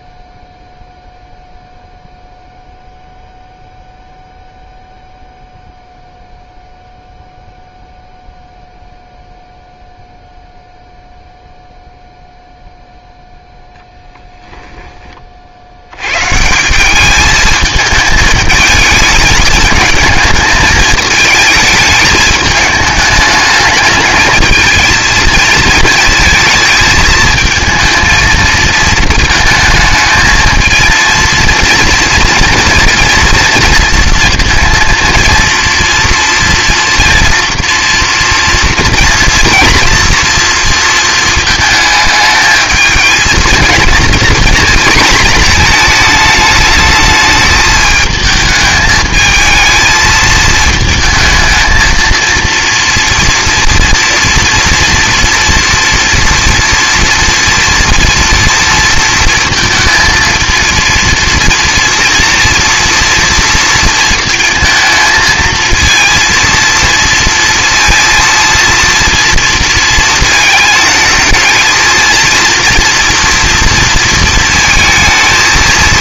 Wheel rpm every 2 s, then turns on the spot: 0, 0, 0, 0, 0, 0, 0, 10, 170, 220, 220, 210, 220, 230, 220, 220, 230, 230, 230, 230, 240, 220, 240, 210, 220, 220, 230, 230, 230, 240, 230, 230, 230, 230, 230, 220, 230, 220.
14-16